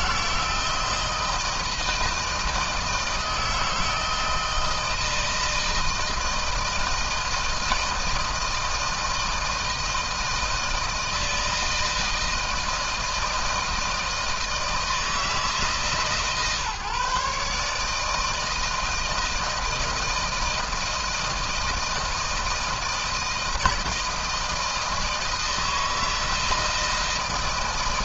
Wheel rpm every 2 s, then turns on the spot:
160, 160, 160, 160, 160, 160, 160, 160, 150, 160, 160, 160, 160, 160.
none